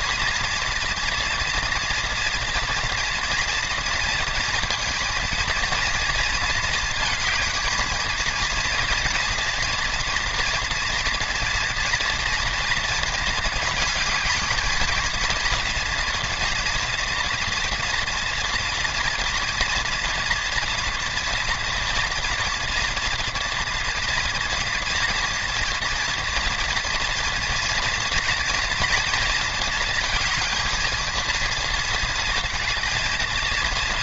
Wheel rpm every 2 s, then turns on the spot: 240, 230, 230, 220, 230, 230, 230, 220, 230, 230, 240, 230, 230, 230, 230, 230, 230.
none